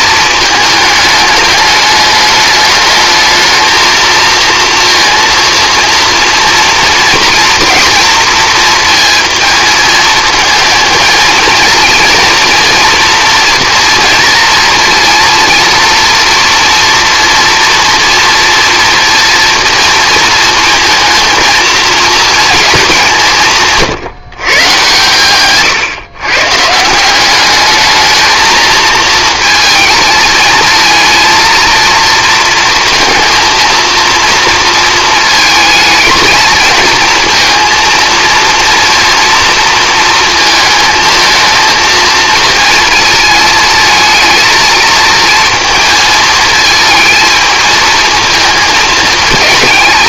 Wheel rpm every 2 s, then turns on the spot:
220, 210, 230, 230, 230, 230, 240, 230, 230, 230, 230, 210, 120, 160, 220, 230, 230, 230, 230, 230, 220, 230, 230, 220, 220.
none